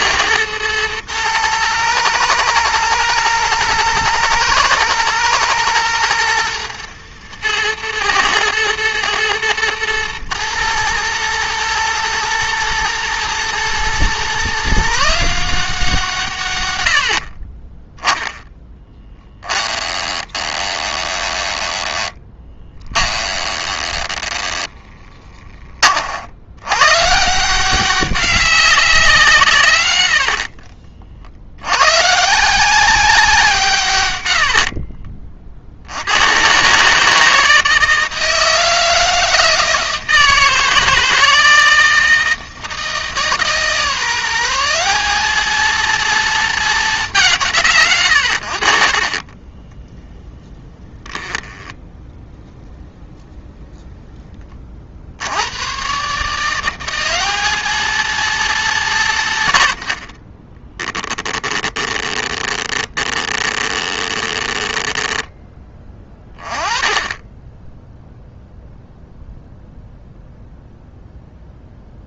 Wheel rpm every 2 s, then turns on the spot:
110, 120, 110, 120, 120, 110, 110, 150, 90, 10, 20, 10, 20, 110, 190, 40, 190, 50, 140, 160, 160, 160, 190, 210, 50, 10, 10, 50, 190, 170, 10, 20, 10, 20, 0, 0.
18-26 34-36 50-52 60-66